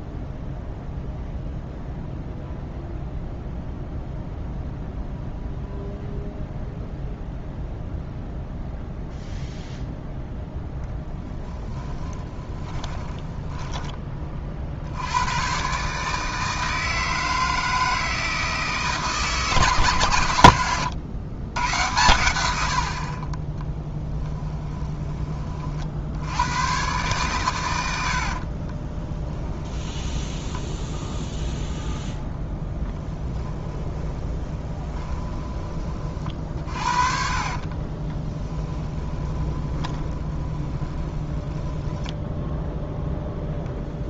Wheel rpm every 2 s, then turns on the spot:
0, 0, 0, 0, 0, 0, 10, 60, 160, 160, 110, 80, 10, 120, 30, 10, 20, 20, 40, 10, 20, 10.
12-14 28-42